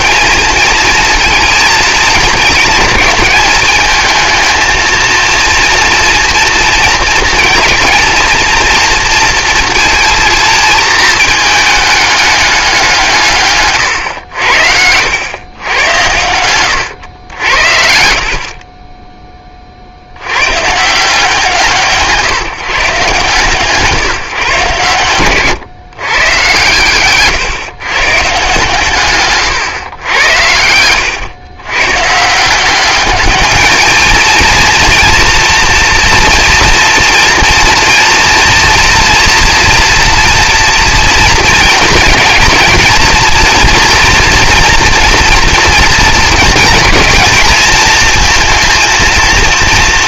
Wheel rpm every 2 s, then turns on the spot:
230, 220, 220, 230, 230, 230, 200, 80, 100, 30, 100, 130, 140, 130, 140, 90, 180, 230, 230, 230, 230, 230, 230, 230, 230.
none